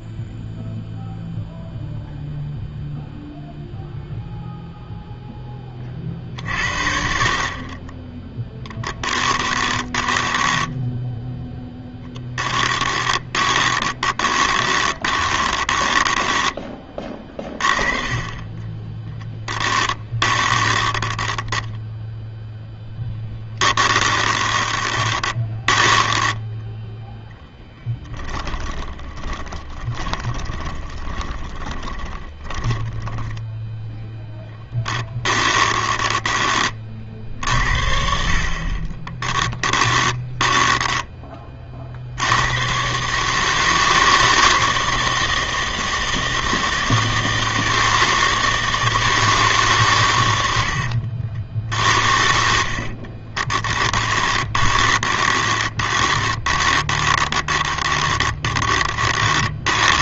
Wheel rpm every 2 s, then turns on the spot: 0, 0, 0, 50, 10, 10, 10, 20, 10, 30, 20, 0, 20, 10, 20, 20, 20, 10, 50, 20, 30, 150, 160, 160, 150, 60, 30, 20, 20, 30.
10-18 20-22 24-36 38-42 52-60